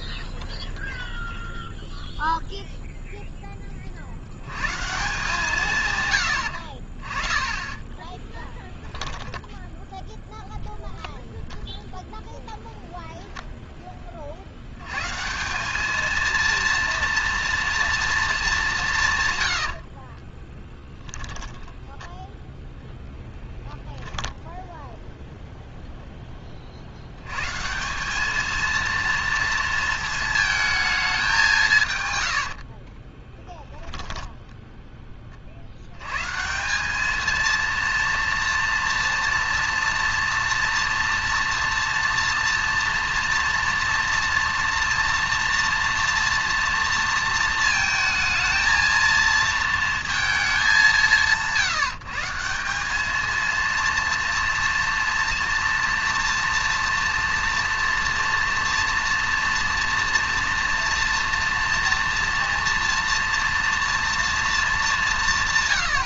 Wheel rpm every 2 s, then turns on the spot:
0, 0, 60, 90, 10, 0, 0, 110, 230, 180, 10, 0, 0, 140, 230, 160, 10, 30, 210, 230, 240, 240, 240, 230, 230, 170, 220, 230, 230, 240, 230, 230, 220.
8-10 20-22